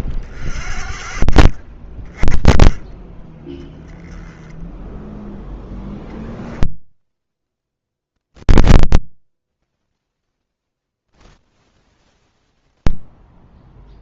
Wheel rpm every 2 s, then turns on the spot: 40, 30, 10, 0, 10, 0, 0.
none